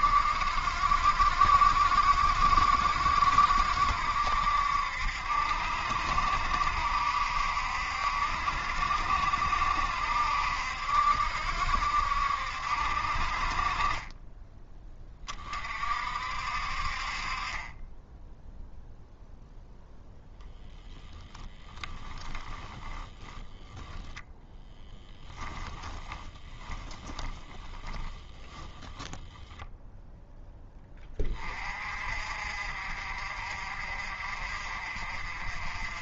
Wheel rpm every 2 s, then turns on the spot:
60, 60, 70, 70, 70, 70, 60, 20, 50, 0, 0, 20, 0, 10, 10, 10, 50, 50.
22-24 26-30